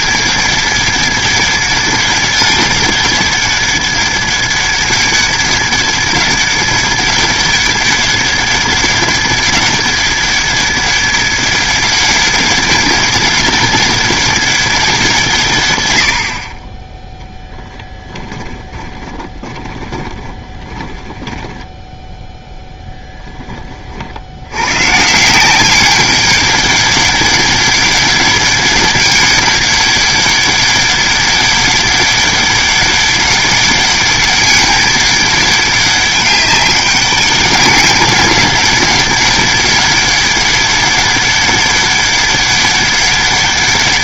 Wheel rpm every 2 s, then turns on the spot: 200, 200, 200, 200, 200, 200, 200, 190, 20, 20, 10, 0, 120, 200, 200, 200, 200, 200, 200, 200, 200, 200.
18-22